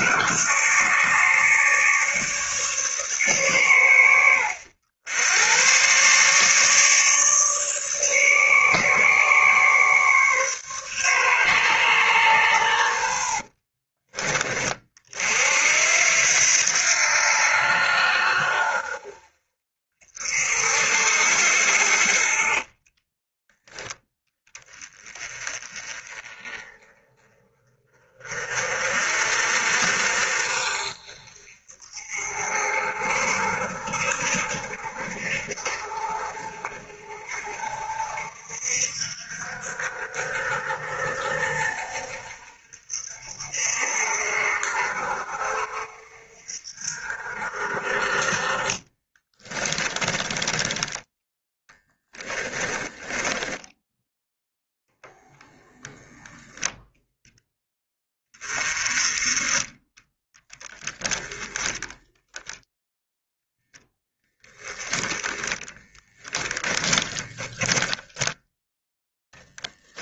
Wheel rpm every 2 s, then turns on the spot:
150, 140, 90, 150, 150, 140, 80, 40, 80, 60, 60, 20, 30, 30, 40, 50, 50, 50, 50, 60, 60, 60, 60, 60, 20, 10, 20, 0, 10, 30, 10, 0, 10, 20, 0.
12-14 22-24 48-50 52-54 66-68